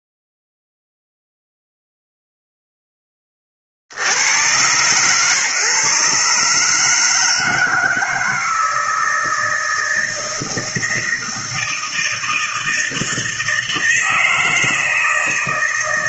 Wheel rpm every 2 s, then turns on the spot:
0, 0, 120, 150, 160, 160, 160, 160.
none